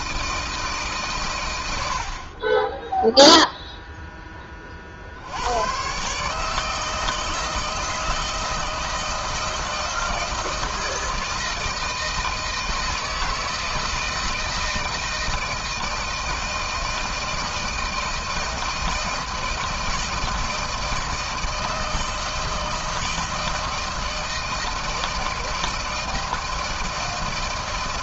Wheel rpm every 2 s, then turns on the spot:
160, 40, 10, 140, 160, 160, 160, 160, 170, 160, 160, 160, 160, 160.
none